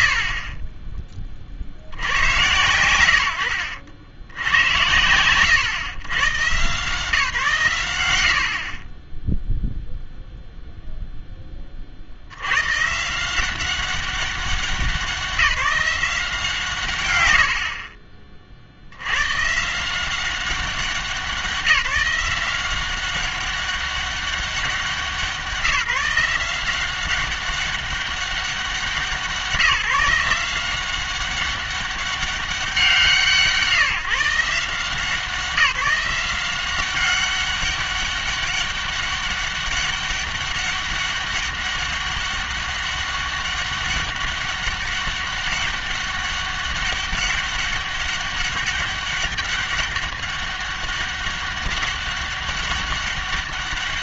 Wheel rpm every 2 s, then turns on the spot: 50, 110, 110, 150, 60, 0, 110, 190, 160, 60, 190, 190, 190, 180, 190, 180, 190, 160, 180, 200, 200, 200, 200, 200, 200, 200, 200.
none